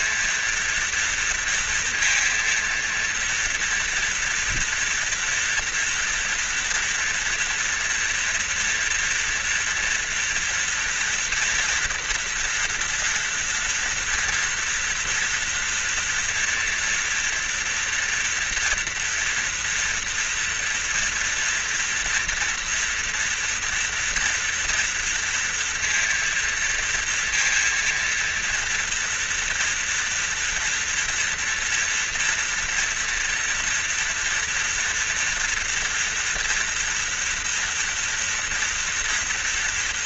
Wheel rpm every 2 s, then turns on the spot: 230, 230, 230, 230, 230, 230, 240, 240, 230, 230, 230, 240, 230, 230, 230, 230, 230, 230, 240, 230.
none